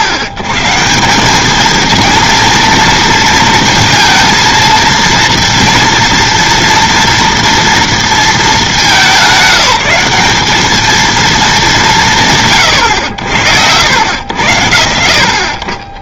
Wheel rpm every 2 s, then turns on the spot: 130, 230, 230, 230, 210, 200, 150, 90.
none